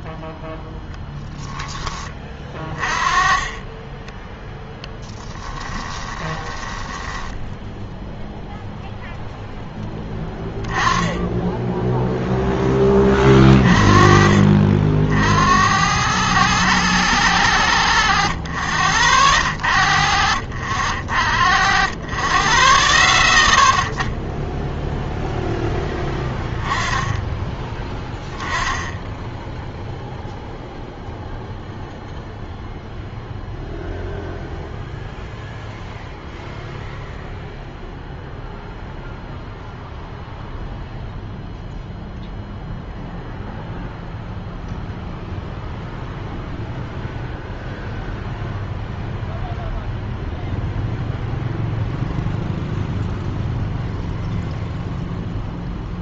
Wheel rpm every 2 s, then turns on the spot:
10, 30, 0, 20, 0, 10, 20, 50, 110, 40, 60, 10, 0, 10, 10, 0, 0, 0, 0, 0, 0, 0, 0, 0, 0, 0, 0, 0.
6-8